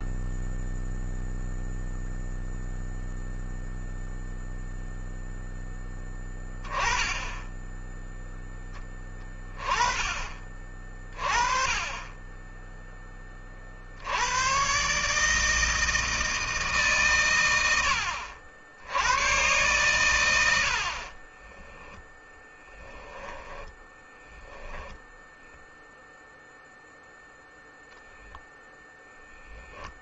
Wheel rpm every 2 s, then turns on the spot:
0, 0, 0, 10, 10, 30, 10, 110, 160, 80, 90, 10, 10, 0, 0.
22-26